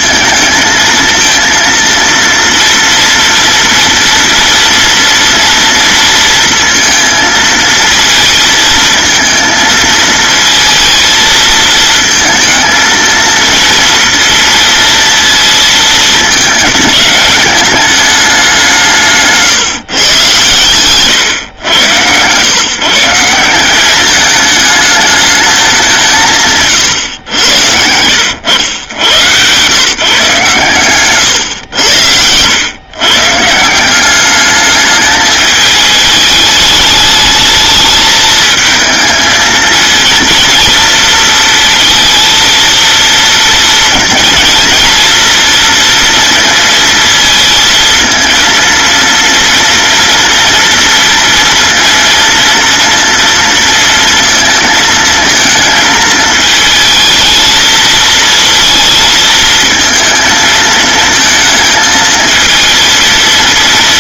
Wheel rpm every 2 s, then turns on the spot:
220, 230, 230, 230, 220, 230, 220, 230, 220, 180, 120, 140, 210, 140, 90, 140, 110, 210, 210, 220, 230, 230, 230, 230, 230, 230, 230, 220, 220, 230, 220, 230.
none